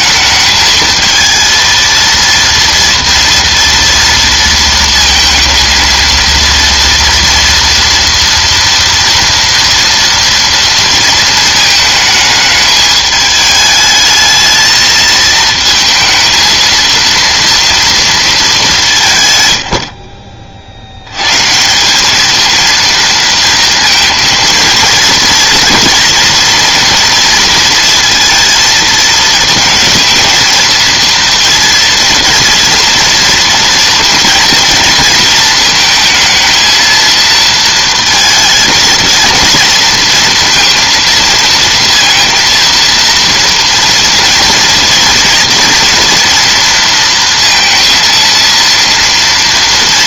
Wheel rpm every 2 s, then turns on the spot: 220, 230, 230, 230, 230, 230, 210, 220, 230, 190, 60, 230, 230, 230, 230, 220, 230, 230, 230, 220, 230, 230, 230, 230, 230.
none